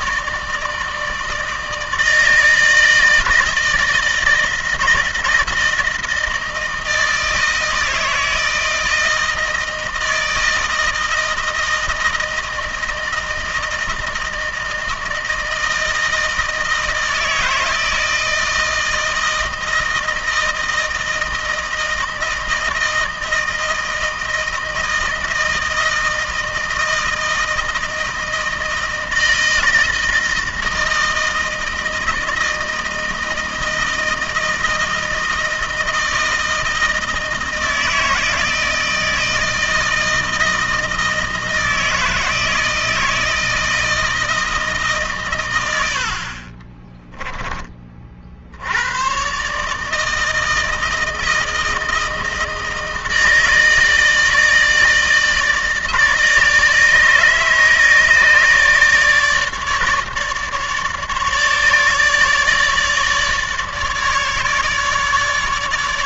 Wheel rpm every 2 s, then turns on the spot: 160, 160, 160, 160, 160, 160, 160, 160, 160, 160, 160, 160, 160, 160, 160, 160, 160, 160, 160, 160, 160, 160, 140, 30, 100, 160, 160, 160, 150, 150, 150, 150, 150.
46-48